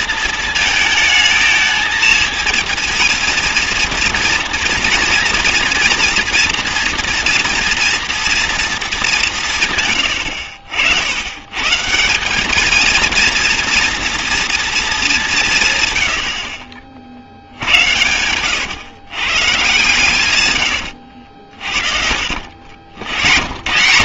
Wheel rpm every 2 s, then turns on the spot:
220, 230, 230, 230, 230, 70, 220, 220, 60, 120, 110, 90.
16-18 20-22